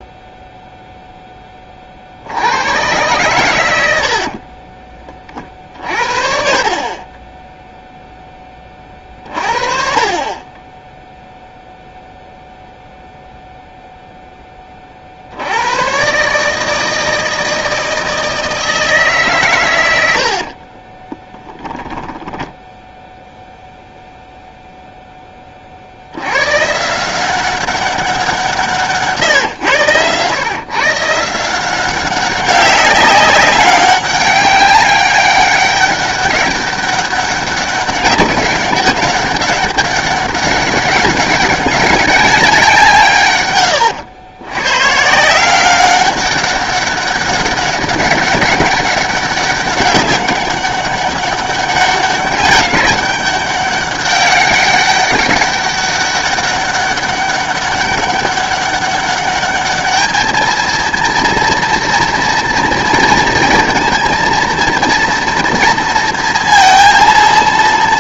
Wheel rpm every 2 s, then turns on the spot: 0, 110, 40, 30, 30, 10, 0, 30, 160, 160, 30, 10, 0, 140, 150, 140, 190, 200, 190, 200, 200, 180, 120, 200, 190, 200, 200, 200, 200, 200, 230, 240, 230, 230.
4-6 20-24